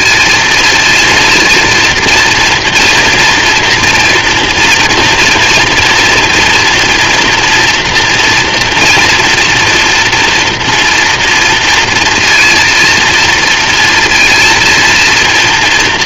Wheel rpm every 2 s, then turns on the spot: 230, 230, 230, 240, 230, 230, 230, 230.
none